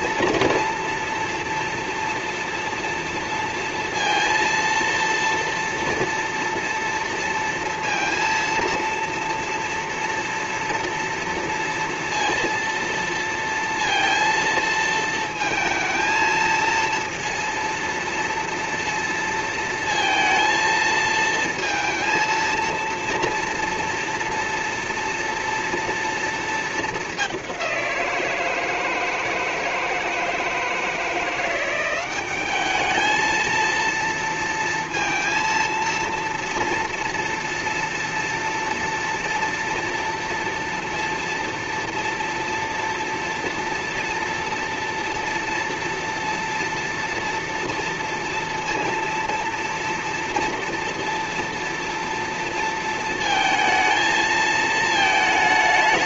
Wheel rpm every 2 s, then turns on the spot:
230, 230, 230, 230, 230, 230, 230, 230, 230, 230, 230, 230, 230, 230, 170, 160, 190, 230, 230, 230, 230, 230, 230, 230, 230, 230, 230, 220.
none